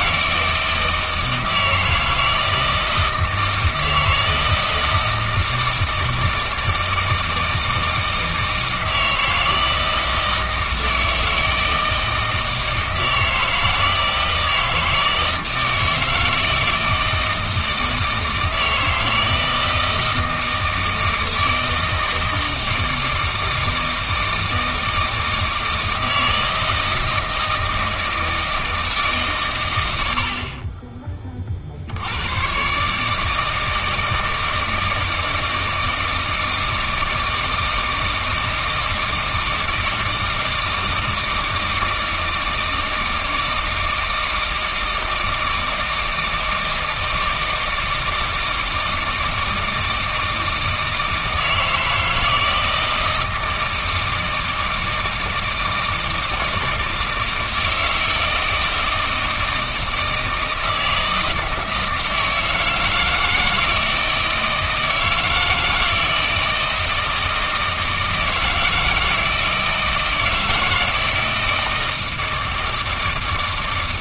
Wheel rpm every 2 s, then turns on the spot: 160, 160, 160, 160, 160, 160, 160, 160, 160, 160, 160, 160, 160, 160, 160, 30, 140, 160, 160, 160, 160, 160, 160, 160, 160, 160, 160, 160, 160, 160, 160, 160, 160, 160, 160, 160, 160.
none